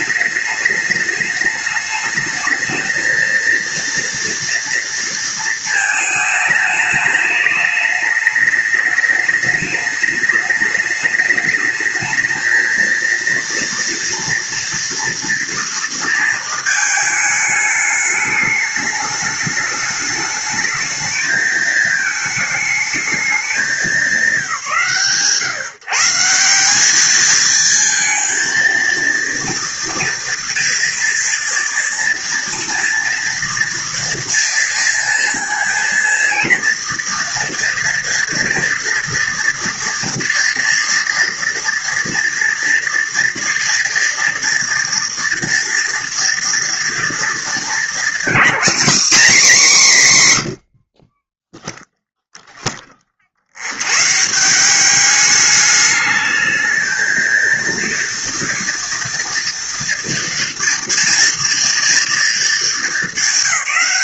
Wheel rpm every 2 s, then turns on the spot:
210, 230, 230, 210, 210, 210, 230, 230, 220, 210, 220, 220, 140, 220, 230, 230, 230, 230, 230, 230, 230, 230, 240, 230, 240, 30, 50, 200, 230, 230, 230, 200.
none